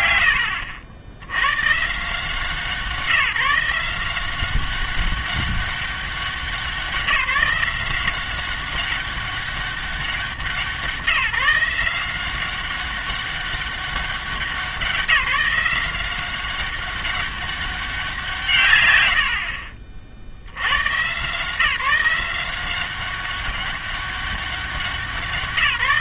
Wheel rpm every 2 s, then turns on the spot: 120, 170, 190, 180, 190, 180, 190, 190, 190, 120, 90, 180, 190.
0-2